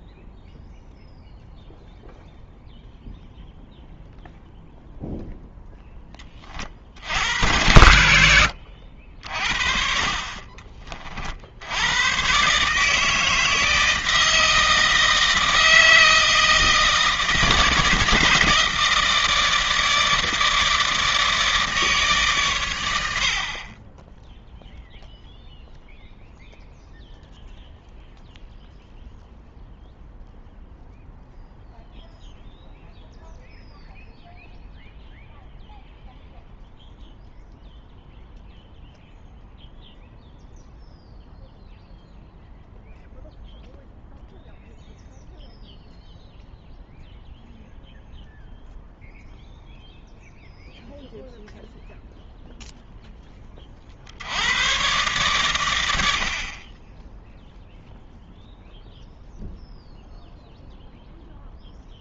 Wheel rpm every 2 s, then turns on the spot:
0, 0, 0, 40, 80, 30, 140, 160, 160, 160, 160, 110, 0, 0, 0, 0, 0, 0, 0, 0, 0, 0, 0, 0, 0, 0, 0, 110, 30, 0, 0.
10-12